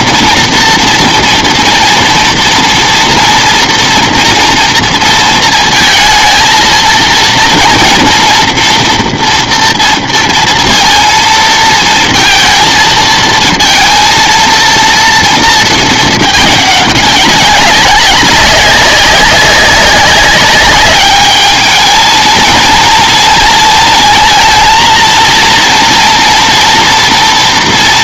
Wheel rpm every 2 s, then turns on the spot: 230, 230, 230, 230, 240, 230, 230, 230, 210, 200, 200, 230, 220, 230.
none